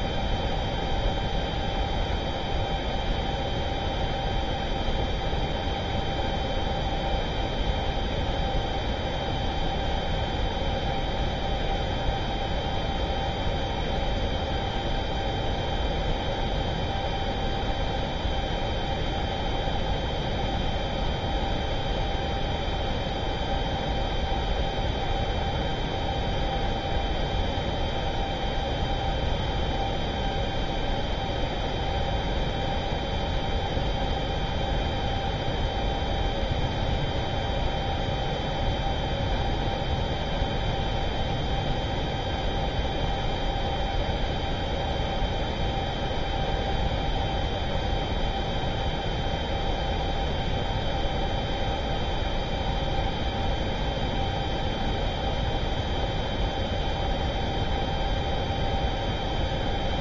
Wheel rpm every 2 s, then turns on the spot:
0, 0, 0, 0, 0, 0, 0, 0, 0, 0, 0, 0, 0, 0, 0, 0, 0, 0, 0, 0, 0, 0, 0, 0, 0, 0, 0, 0, 0, 0.
none